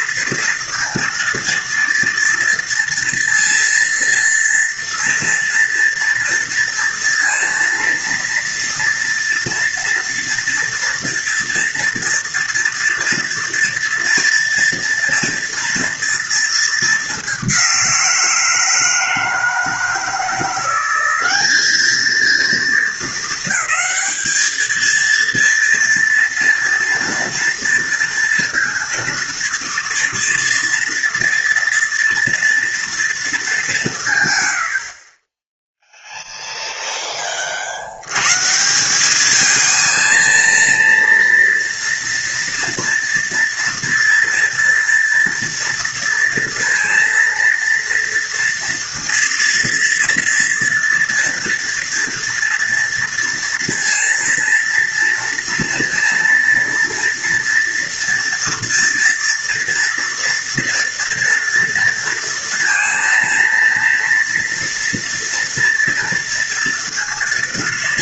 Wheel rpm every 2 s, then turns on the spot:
230, 230, 230, 230, 230, 230, 230, 240, 210, 160, 180, 220, 220, 230, 230, 230, 230, 60, 10, 180, 230, 230, 230, 230, 230, 230, 230, 230, 230, 230, 230, 230, 230, 230.
none